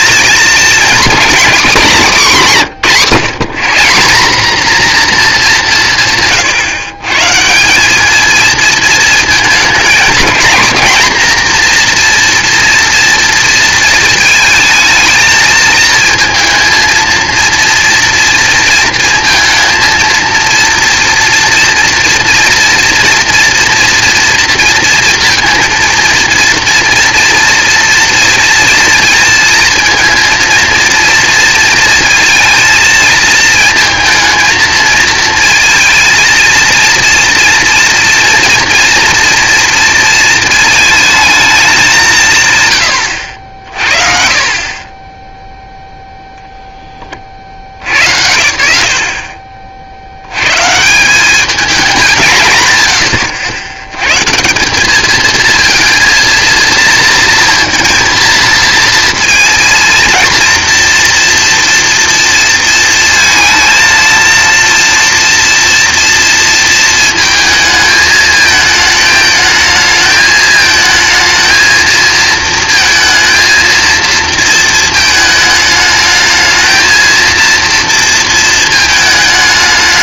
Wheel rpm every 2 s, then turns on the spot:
240, 190, 230, 130, 220, 230, 240, 220, 230, 230, 230, 230, 230, 230, 230, 230, 230, 220, 230, 230, 220, 120, 20, 20, 80, 150, 110, 200, 230, 230, 240, 230, 230, 220, 210, 220, 220, 230, 220, 220.
none